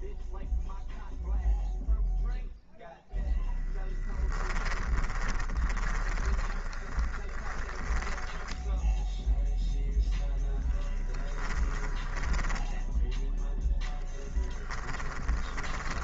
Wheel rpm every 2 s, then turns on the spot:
0, 0, 20, 20, 10, 10, 10, 10.
4-10 12-16